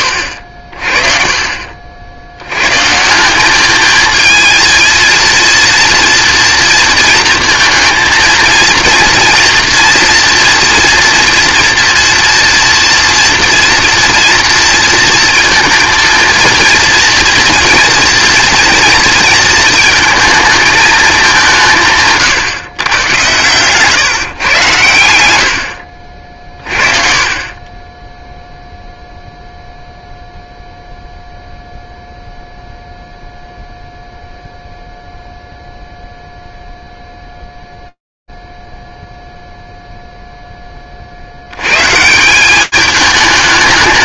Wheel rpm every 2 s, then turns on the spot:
60, 130, 230, 230, 230, 240, 240, 230, 230, 230, 220, 130, 110, 40, 0, 0, 0, 0, 0, 0, 60, 220.
none